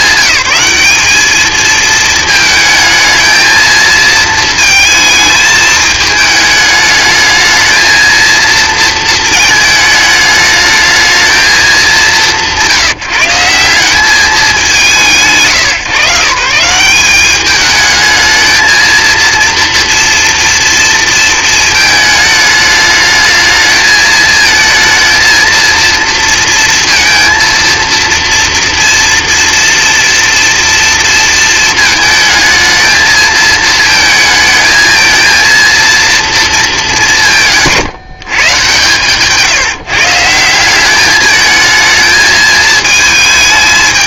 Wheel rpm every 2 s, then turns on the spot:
200, 220, 220, 210, 230, 220, 180, 210, 140, 220, 230, 210, 220, 230, 230, 230, 220, 220, 210, 140, 170, 220.
none